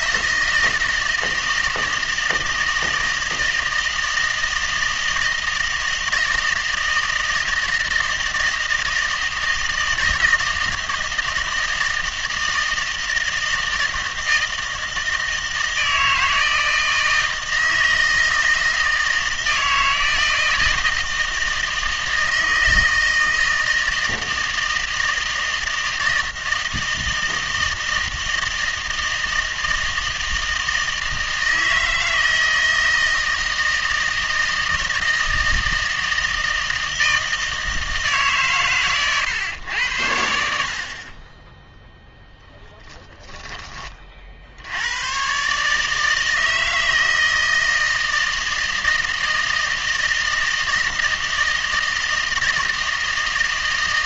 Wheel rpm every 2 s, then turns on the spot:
160, 160, 160, 160, 160, 160, 160, 160, 160, 160, 160, 160, 160, 160, 160, 160, 160, 160, 160, 130, 60, 10, 70, 160, 160, 160, 160.
none